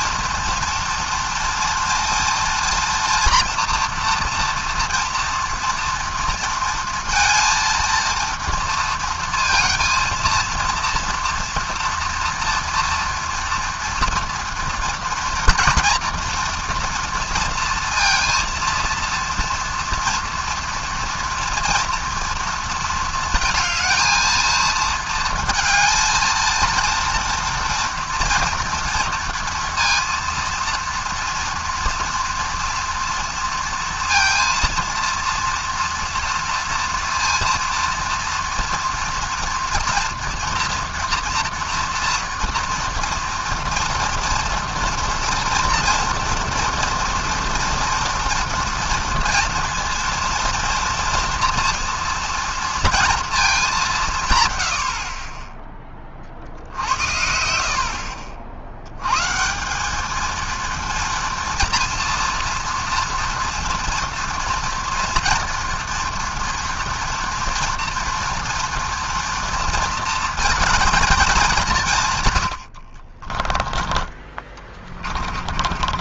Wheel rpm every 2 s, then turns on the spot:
240, 230, 230, 230, 230, 230, 230, 230, 230, 230, 240, 230, 230, 230, 230, 230, 230, 230, 240, 240, 230, 230, 230, 230, 230, 230, 230, 110, 60, 60, 230, 230, 230, 230, 240, 220, 90, 20.
74-76